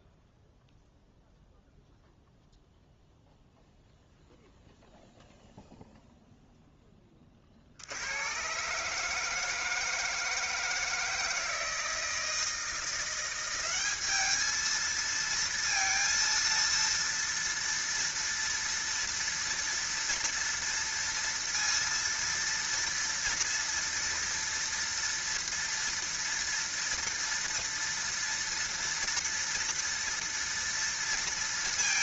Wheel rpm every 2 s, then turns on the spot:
0, 0, 0, 10, 150, 160, 170, 220, 230, 230, 230, 230, 230, 230, 230, 230.
none